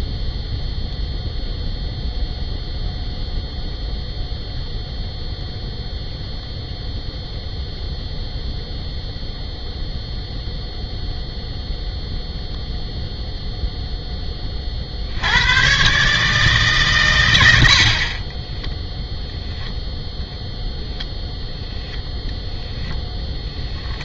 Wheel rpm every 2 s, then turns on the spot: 0, 0, 0, 0, 0, 0, 0, 40, 130, 0, 0, 10.
none